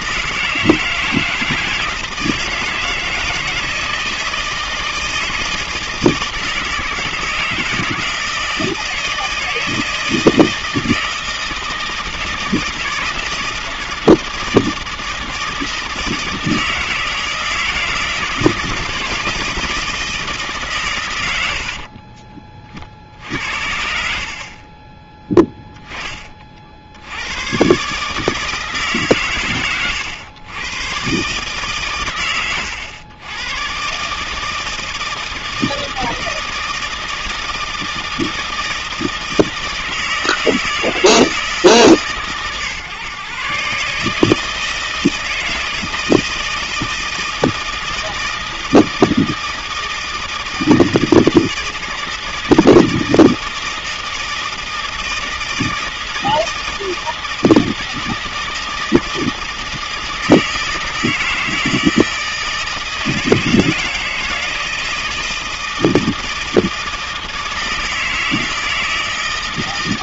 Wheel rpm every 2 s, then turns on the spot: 160, 160, 160, 160, 160, 160, 160, 160, 160, 160, 140, 40, 30, 40, 150, 120, 100, 160, 160, 160, 160, 130, 160, 160, 160, 160, 160, 160, 160, 160, 160, 160, 160, 160, 160.
24-26